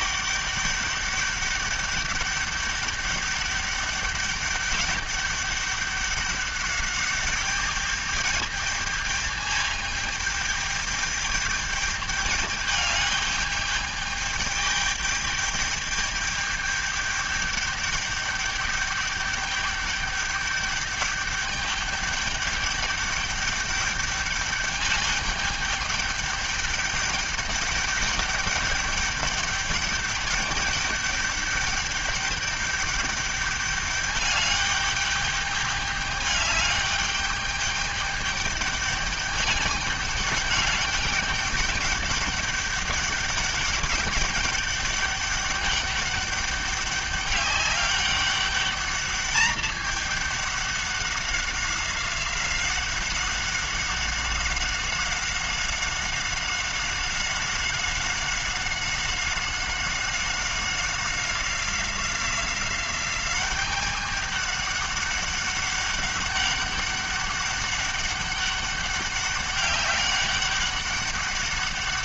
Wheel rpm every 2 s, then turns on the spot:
200, 200, 200, 200, 210, 210, 210, 210, 210, 210, 200, 200, 210, 210, 200, 210, 210, 210, 200, 210, 200, 200, 200, 200, 200, 200, 190, 190, 190, 190, 190, 190, 200, 200, 200, 200.
none